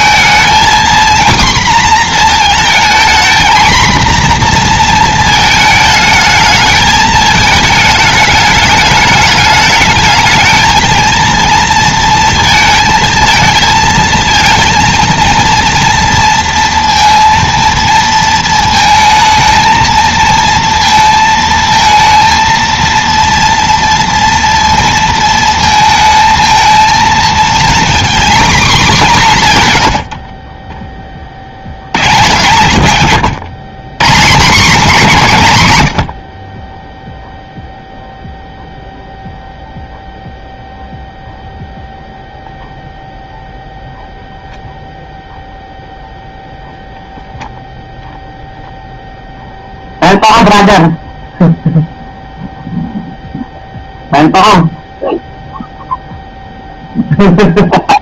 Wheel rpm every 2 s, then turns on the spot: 240, 230, 240, 220, 210, 220, 220, 230, 230, 220, 230, 230, 230, 220, 220, 20, 130, 190, 10, 0, 0, 0, 0, 0, 0, 0, 0, 0, 0.
none